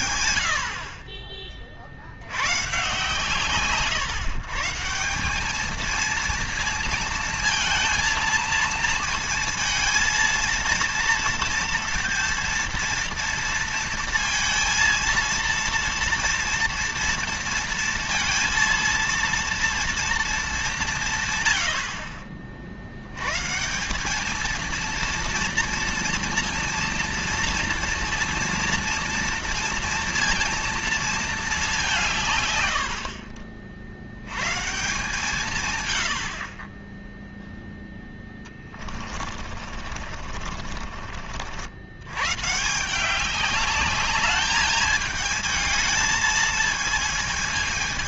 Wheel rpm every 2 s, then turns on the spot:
60, 120, 150, 230, 230, 230, 230, 230, 230, 230, 200, 60, 230, 230, 230, 230, 120, 130, 40, 20, 40, 150, 210, 220.
38-42